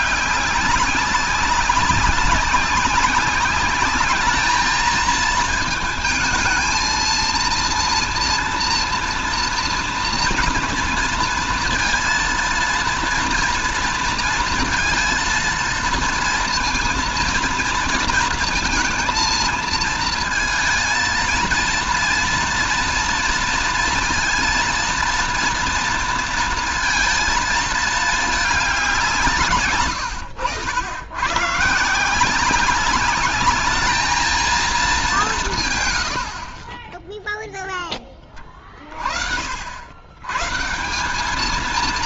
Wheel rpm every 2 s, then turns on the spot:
200, 200, 220, 230, 230, 230, 230, 230, 230, 230, 230, 230, 230, 230, 200, 90, 200, 220, 40, 30, 150.
none